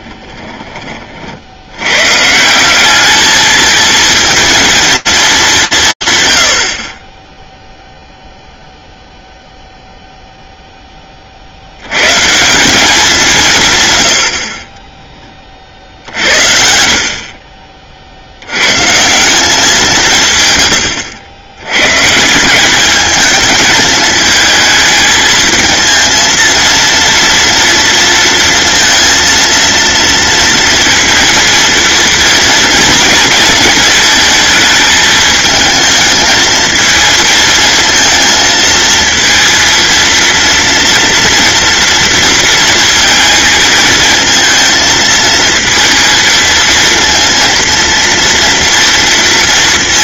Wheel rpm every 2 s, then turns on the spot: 30, 190, 230, 40, 0, 20, 200, 20, 60, 120, 100, 200, 220, 230, 230, 230, 230, 220, 220, 220, 240, 230, 220, 230, 230.
16-18 20-22